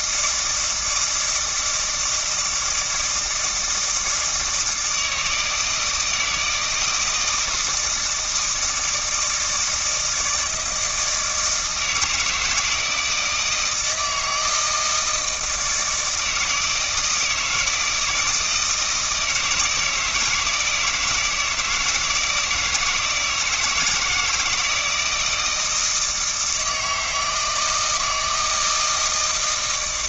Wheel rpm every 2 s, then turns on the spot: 160, 160, 160, 160, 160, 160, 160, 160, 160, 170, 160, 160, 160, 160, 160.
none